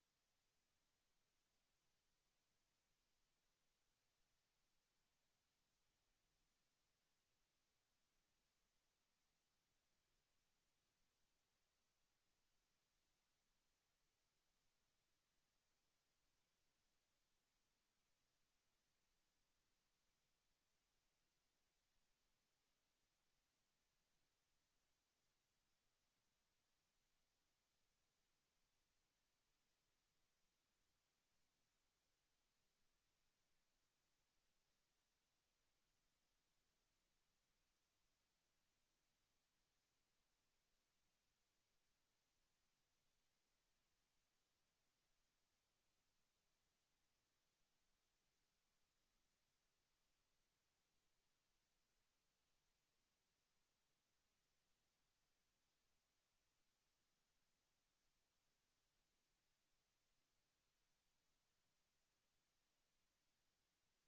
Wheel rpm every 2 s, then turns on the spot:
0, 0, 0, 0, 0, 0, 0, 0, 0, 0, 0, 0, 0, 0, 0, 0, 0, 0, 0, 0, 0, 0, 0, 0, 0, 0, 0, 0, 0, 0, 0, 0.
none